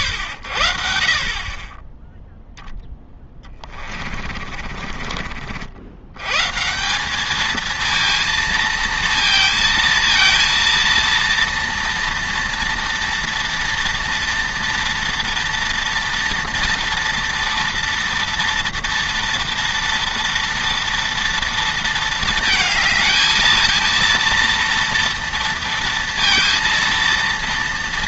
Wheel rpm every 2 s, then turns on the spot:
80, 0, 40, 150, 230, 230, 230, 230, 230, 230, 230, 220, 230, 230.
4-6